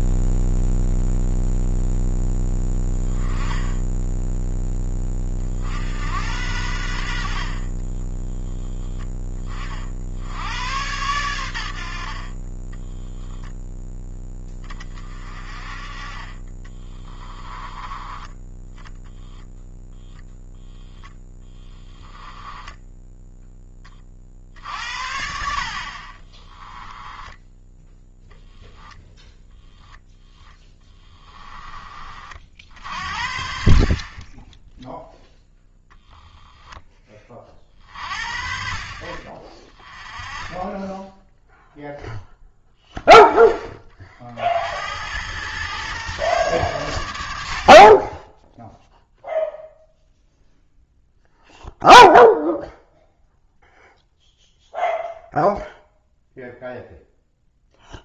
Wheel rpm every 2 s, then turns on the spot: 0, 10, 10, 80, 0, 100, 10, 20, 20, 20, 20, 20, 70, 10, 0, 10, 60, 0, 20, 50, 10, 10, 80, 110, 0, 0, 0, 0, 0.
12-14 16-24 26-28 30-32